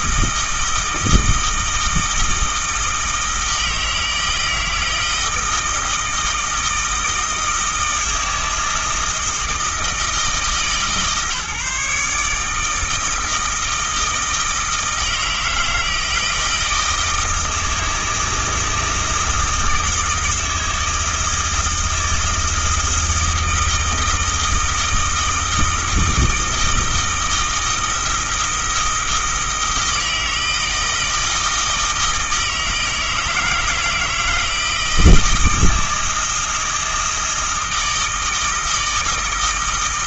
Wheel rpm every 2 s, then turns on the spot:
160, 160, 160, 160, 160, 150, 160, 160, 160, 160, 160, 160, 160, 160, 160, 160, 160, 170, 160, 160.
none